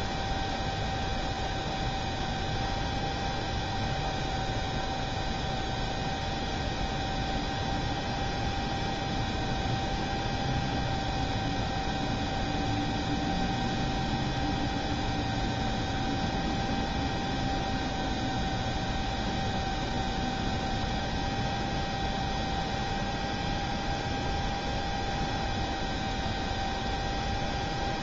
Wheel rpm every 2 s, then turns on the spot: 0, 0, 0, 0, 0, 0, 0, 0, 0, 0, 0, 0, 0, 0.
none